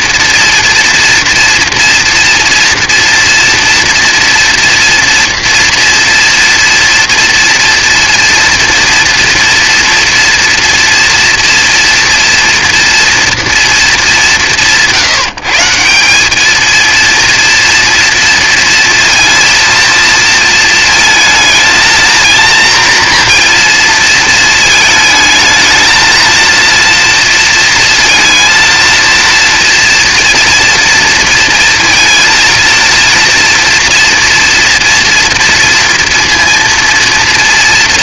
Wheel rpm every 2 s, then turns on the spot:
240, 230, 230, 230, 240, 230, 230, 170, 230, 230, 220, 230, 220, 230, 230, 230, 230, 240, 230.
none